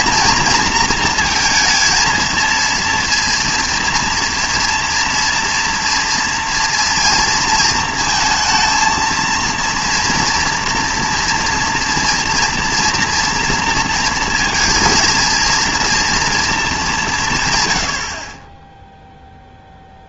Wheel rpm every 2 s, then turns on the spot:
230, 230, 230, 230, 230, 230, 230, 230, 210, 10.
none